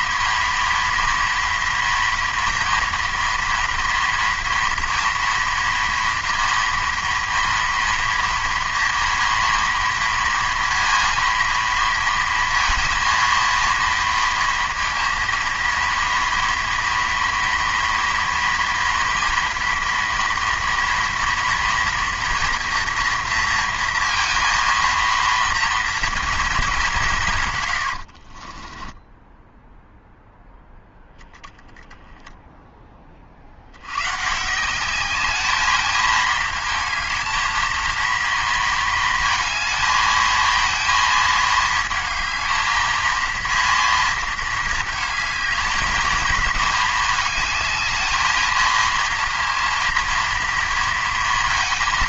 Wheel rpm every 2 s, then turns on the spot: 230, 230, 230, 230, 230, 230, 230, 230, 230, 230, 230, 230, 230, 210, 20, 0, 10, 160, 220, 230, 230, 220, 220, 220, 220, 230.
28-30